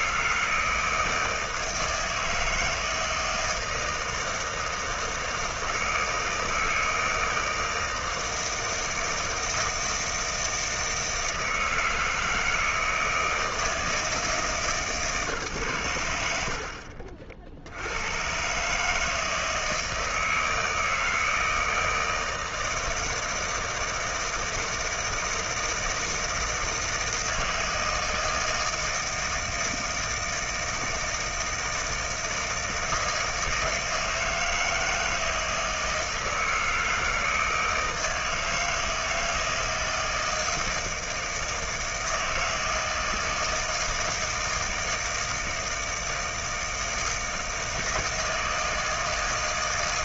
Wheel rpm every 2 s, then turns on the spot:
160, 160, 160, 160, 160, 160, 160, 150, 60, 140, 160, 160, 160, 160, 160, 160, 160, 160, 160, 160, 160, 160, 160, 160, 160.
none